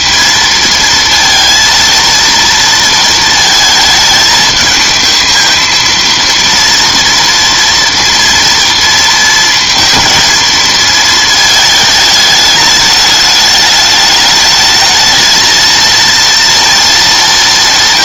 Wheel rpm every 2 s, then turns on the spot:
230, 230, 220, 230, 230, 230, 210, 220, 230.
none